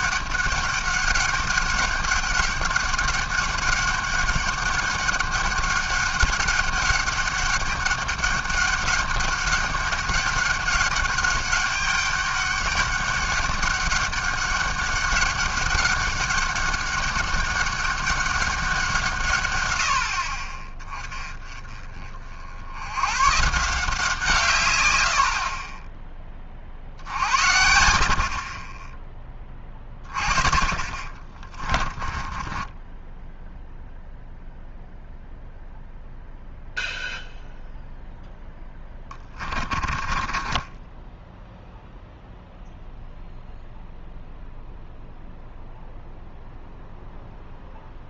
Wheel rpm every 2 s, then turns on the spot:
200, 200, 200, 200, 200, 200, 200, 200, 200, 190, 30, 70, 130, 40, 20, 30, 10, 0, 0, 10, 20, 0, 0, 0.
32-34 38-42